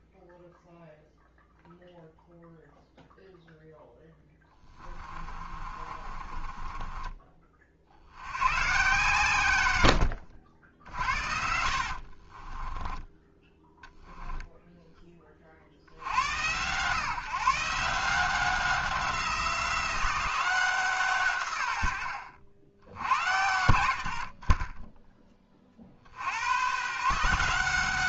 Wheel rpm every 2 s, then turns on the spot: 0, 0, 20, 20, 140, 60, 20, 10, 120, 180, 160, 80, 30, 130.
4-8 10-14 24-26